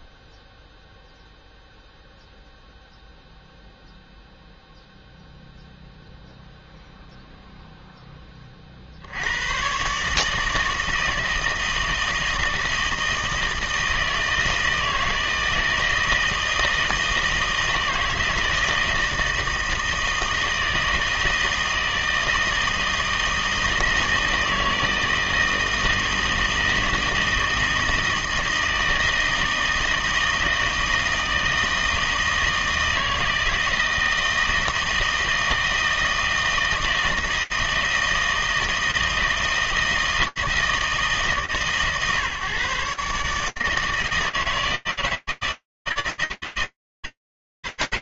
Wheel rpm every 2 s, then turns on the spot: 0, 0, 0, 0, 30, 160, 160, 160, 160, 160, 160, 160, 160, 160, 160, 160, 160, 160, 160, 160, 150, 140, 160, 150.
none